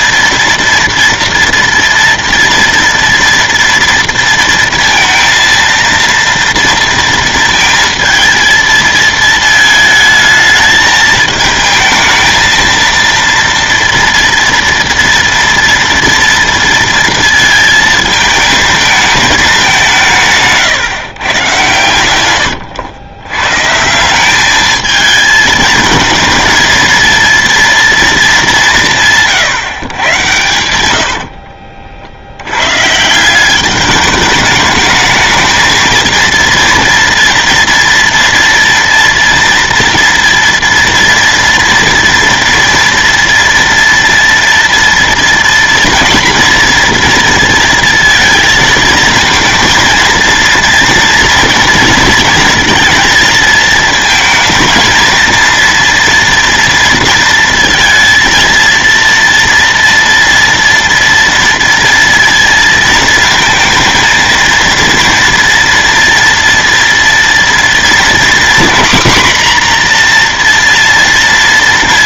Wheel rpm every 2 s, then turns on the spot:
230, 240, 230, 230, 220, 220, 230, 230, 230, 220, 140, 100, 220, 230, 160, 90, 140, 210, 230, 230, 240, 230, 230, 240, 230, 230, 230, 230, 230, 230, 230, 230, 230, 230, 250, 240.
30-32